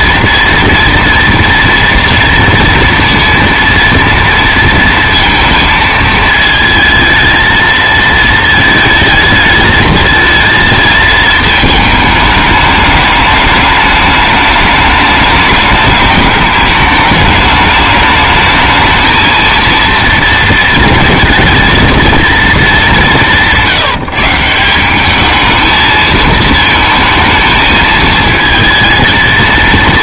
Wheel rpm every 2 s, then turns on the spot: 230, 230, 230, 220, 220, 220, 210, 210, 200, 220, 230, 200, 190, 220, 220.
none